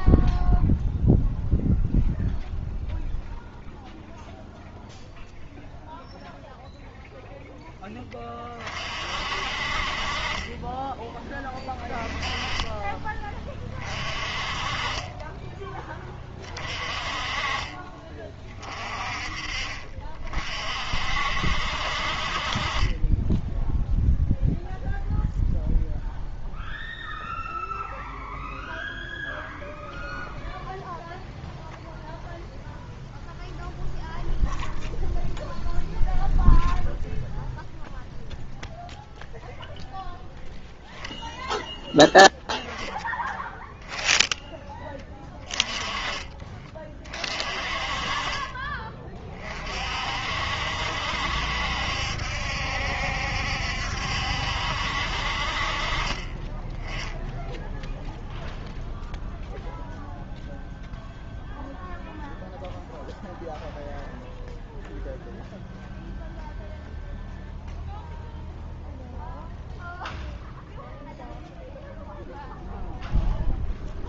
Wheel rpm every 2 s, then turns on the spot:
0, 0, 0, 0, 30, 20, 20, 30, 30, 30, 50, 30, 0, 0, 0, 0, 0, 0, 0, 0, 0, 10, 10, 30, 30, 60, 70, 60, 10, 0, 0, 0, 0, 0, 0, 0, 0.
none